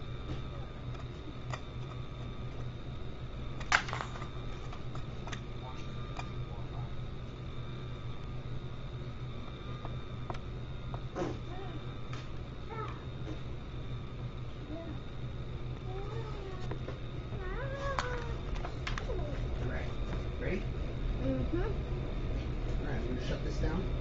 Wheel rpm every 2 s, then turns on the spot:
0, 0, 0, 0, 0, 0, 0, 0, 0, 0, 0, 0.
none